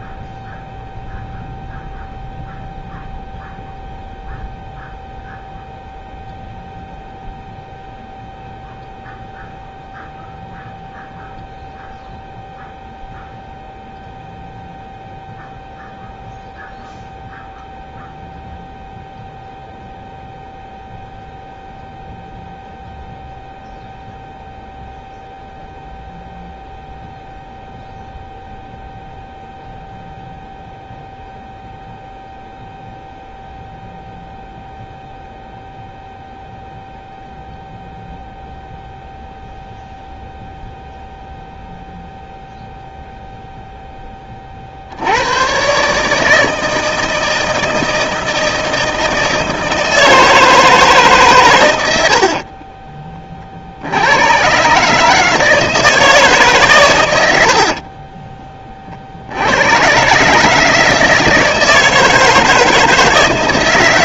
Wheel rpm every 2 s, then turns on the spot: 0, 0, 0, 0, 0, 0, 0, 0, 0, 0, 0, 0, 0, 0, 0, 0, 0, 0, 0, 0, 0, 0, 50, 160, 160, 160, 40, 130, 130, 20, 150, 160.
52-54